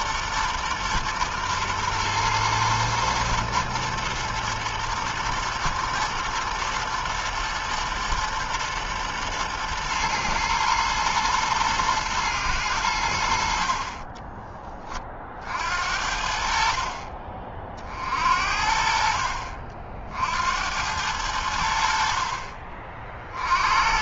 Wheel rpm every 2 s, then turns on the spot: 120, 110, 120, 120, 110, 110, 110, 20, 60, 60, 60, 50.
14-16